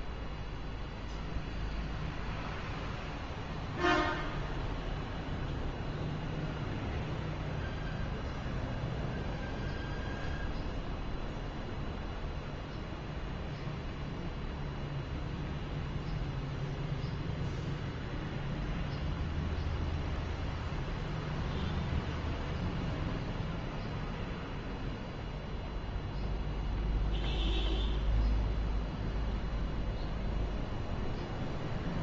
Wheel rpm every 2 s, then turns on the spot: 0, 0, 0, 0, 0, 0, 0, 0, 0, 0, 0, 0, 0, 0, 0, 0.
none